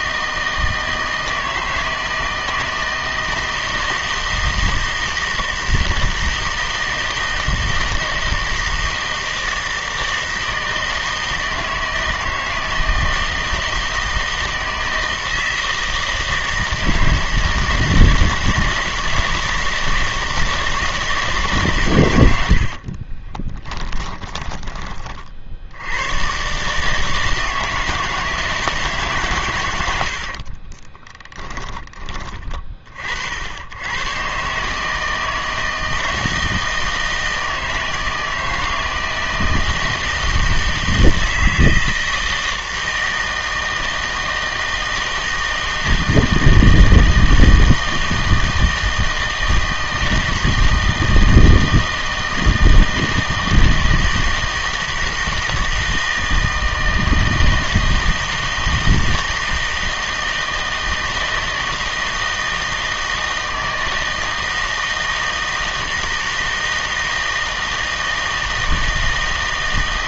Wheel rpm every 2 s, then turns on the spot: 160, 160, 160, 160, 160, 160, 160, 160, 160, 160, 160, 60, 10, 140, 160, 30, 40, 150, 160, 160, 160, 160, 160, 160, 160, 160, 160, 160, 160, 160, 160, 160, 160, 160, 160.
22-24 30-32